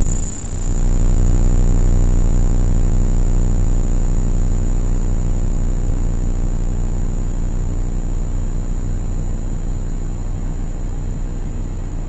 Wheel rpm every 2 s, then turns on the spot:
0, 0, 0, 0, 0, 0.
none